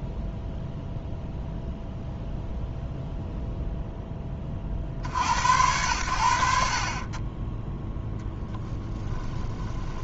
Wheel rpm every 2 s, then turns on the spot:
0, 0, 50, 40, 10.
8-10